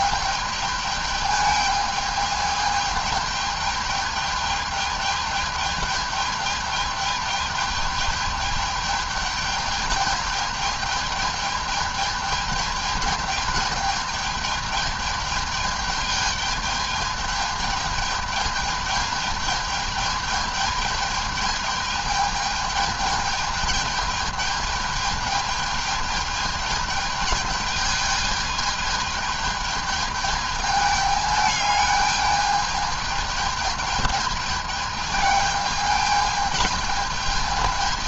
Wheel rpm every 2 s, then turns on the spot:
210, 210, 210, 210, 210, 210, 220, 210, 210, 210, 210, 210, 220, 210, 210, 210, 210, 210, 210.
none